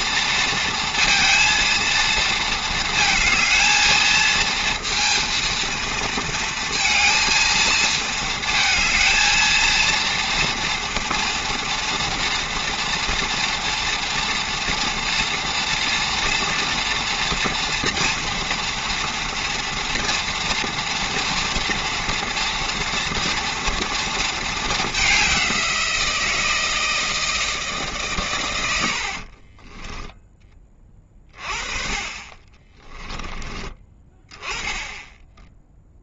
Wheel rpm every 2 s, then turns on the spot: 230, 230, 220, 230, 220, 230, 230, 230, 230, 230, 230, 230, 220, 170, 120, 10, 30, 20.
none